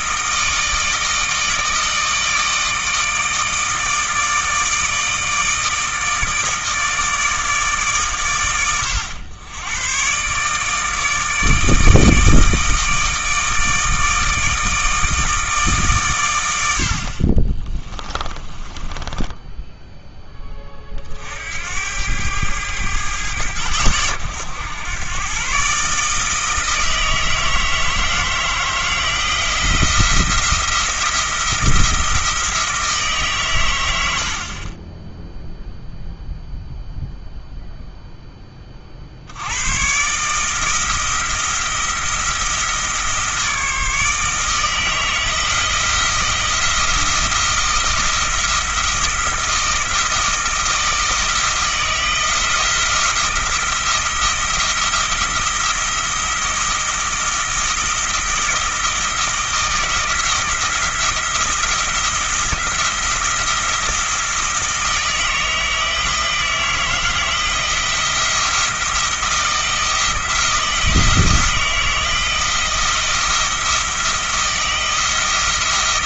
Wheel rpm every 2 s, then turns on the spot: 160, 160, 160, 160, 100, 150, 160, 160, 80, 20, 30, 110, 90, 160, 170, 170, 160, 20, 0, 30, 160, 160, 160, 170, 170, 160, 170, 170, 170, 160, 170, 170, 160, 170, 170, 160, 170, 160.
18-20